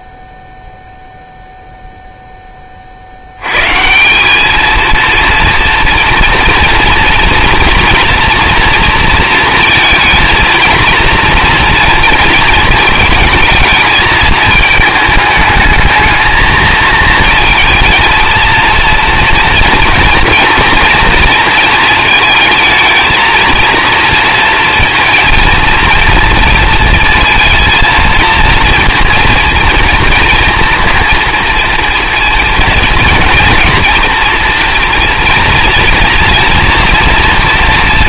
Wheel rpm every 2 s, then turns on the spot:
0, 20, 220, 240, 230, 230, 230, 220, 230, 230, 230, 220, 230, 230, 230, 230, 230, 230, 230.
none